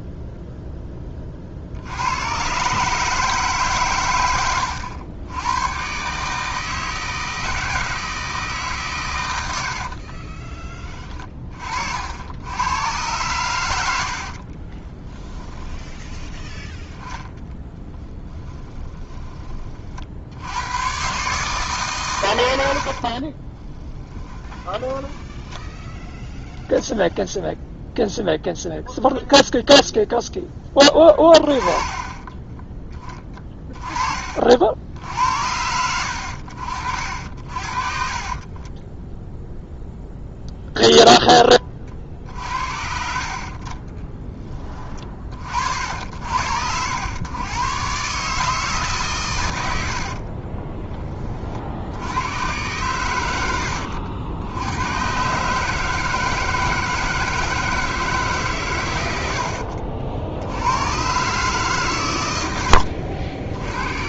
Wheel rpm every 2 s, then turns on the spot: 10, 140, 100, 160, 130, 30, 100, 20, 10, 10, 110, 70, 10, 10, 0, 10, 20, 70, 60, 30, 0, 50, 20, 80, 140, 20, 100, 110, 160, 120, 100, 70.
14-16 18-20 22-26 38-40 62-64